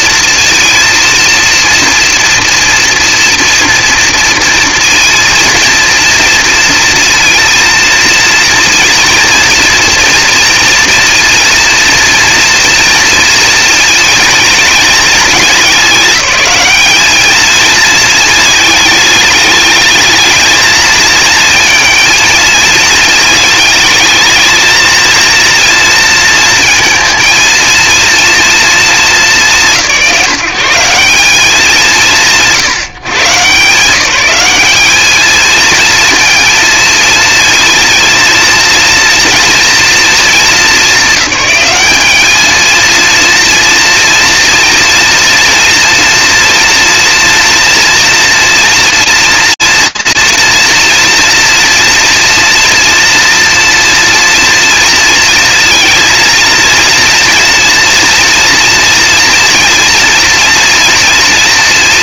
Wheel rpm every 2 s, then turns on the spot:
230, 240, 230, 230, 230, 230, 230, 220, 210, 220, 220, 220, 230, 230, 220, 190, 140, 210, 230, 230, 210, 220, 230, 240, 230, 230, 230, 230, 230, 230, 230.
none